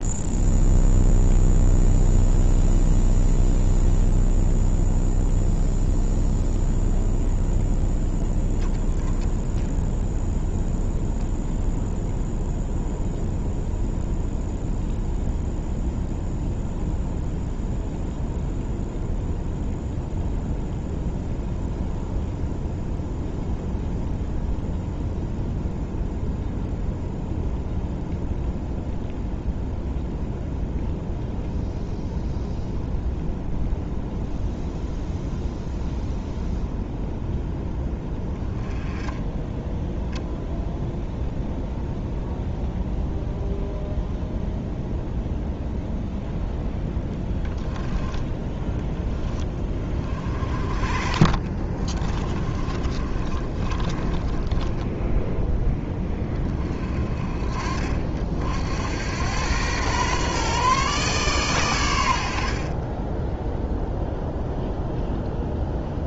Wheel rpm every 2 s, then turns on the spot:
0, 0, 0, 0, 0, 0, 0, 0, 0, 0, 0, 0, 0, 0, 0, 0, 0, 0, 0, 10, 0, 0, 0, 0, 10, 40, 30, 20, 30, 80, 140, 30, 0.
52-56 62-64